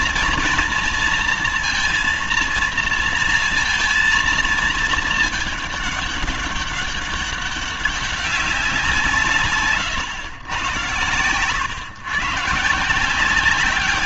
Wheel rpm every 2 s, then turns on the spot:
230, 230, 230, 200, 190, 110, 140.
none